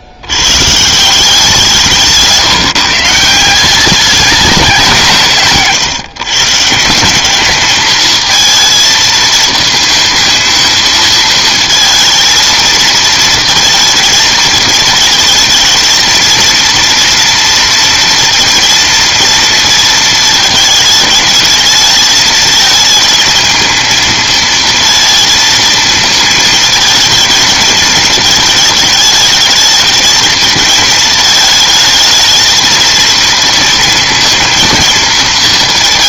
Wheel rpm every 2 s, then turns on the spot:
130, 160, 190, 160, 220, 220, 230, 220, 230, 230, 220, 220, 230, 220, 220, 220, 220, 230.
none